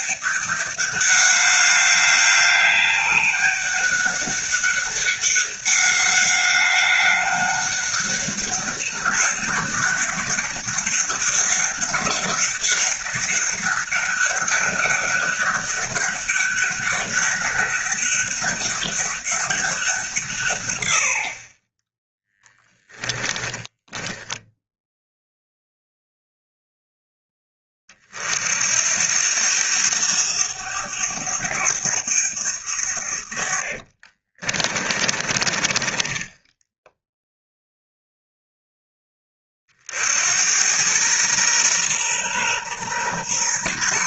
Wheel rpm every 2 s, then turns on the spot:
200, 200, 200, 200, 200, 200, 200, 200, 200, 200, 90, 20, 0, 0, 70, 100, 80, 20, 0, 10, 100, 130.
22-24 34-36